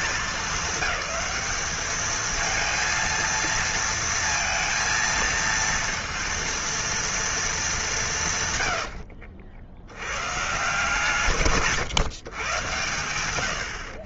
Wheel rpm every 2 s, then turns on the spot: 200, 220, 230, 230, 120, 150, 120.
none